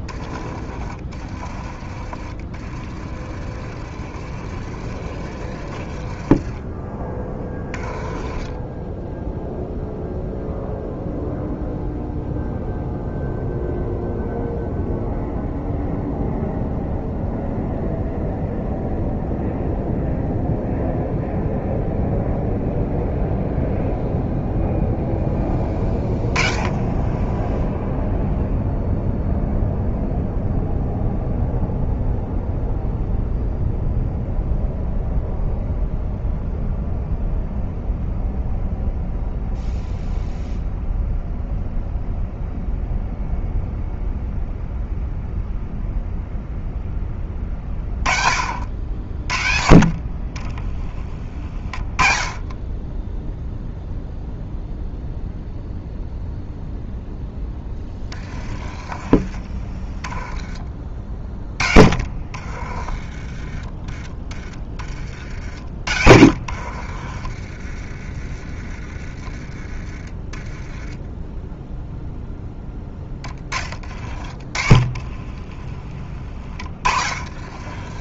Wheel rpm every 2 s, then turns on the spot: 30, 40, 40, 20, 10, 0, 0, 0, 0, 0, 0, 0, 0, 20, 0, 0, 0, 0, 0, 0, 0, 0, 0, 10, 60, 20, 20, 0, 0, 30, 20, 30, 40, 60, 30, 10, 10, 30, 30.
0-6 8-10 58-60 62-68 74-78